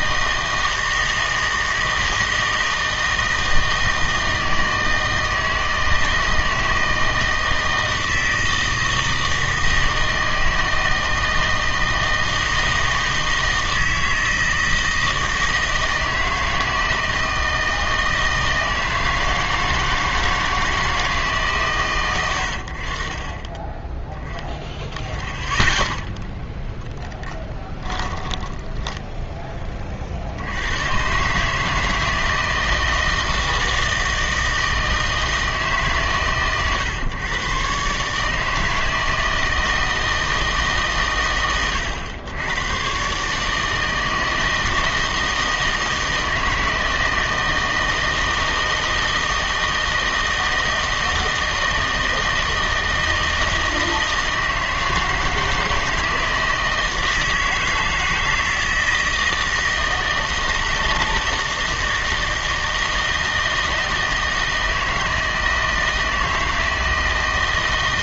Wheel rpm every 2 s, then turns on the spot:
160, 160, 160, 160, 160, 160, 160, 160, 160, 160, 160, 60, 10, 0, 10, 100, 160, 160, 130, 160, 140, 110, 160, 160, 160, 160, 160, 160, 160, 160, 160, 160, 160, 160.
28-30